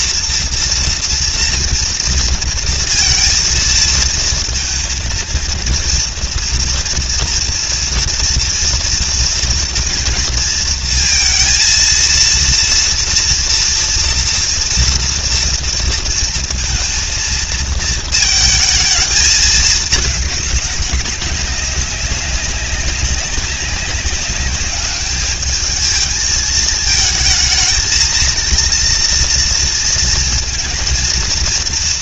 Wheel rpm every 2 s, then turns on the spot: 230, 230, 230, 230, 230, 230, 230, 230, 230, 220, 200, 190, 200, 220, 240, 230.
none